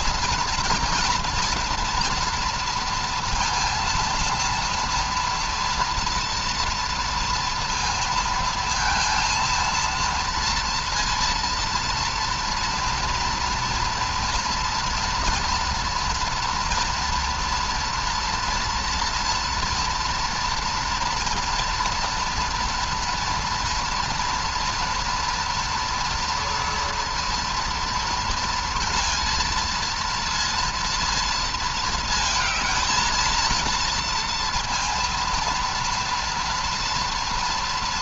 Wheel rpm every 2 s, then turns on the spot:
230, 230, 230, 230, 230, 230, 230, 230, 230, 230, 230, 230, 230, 230, 230, 230, 220, 230, 230.
none